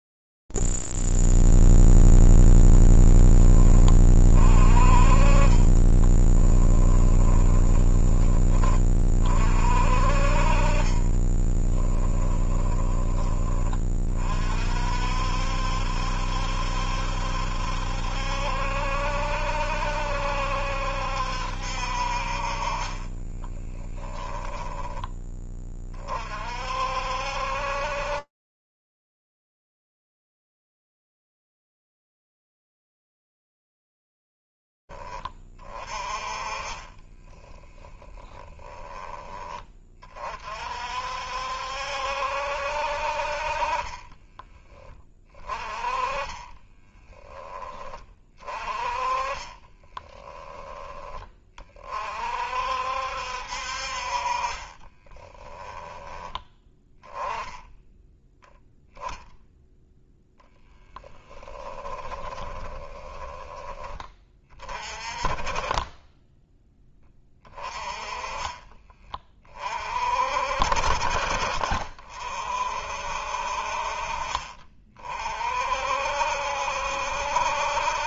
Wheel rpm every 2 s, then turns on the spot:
0, 0, 20, 20, 10, 40, 10, 40, 70, 70, 70, 50, 10, 40, 70, 60, 20, 30, 30, 10, 30, 70, 30, 30, 30, 20, 40, 50, 10, 0, 10, 20, 30, 10, 20, 40, 50, 40, 60.
6-8 12-14 24-26 34-36 38-40 44-48 62-64 68-70